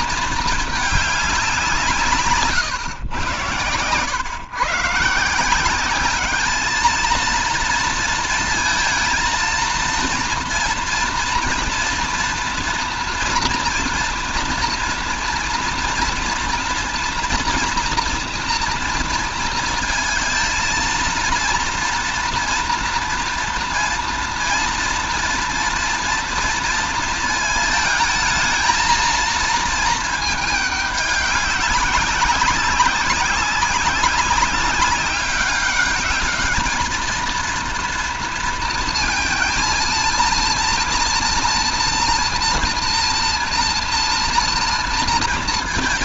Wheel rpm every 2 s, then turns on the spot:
220, 150, 130, 210, 230, 240, 240, 240, 230, 230, 220, 240, 230, 230, 220, 210, 190, 200, 220, 230, 230, 230, 240.
none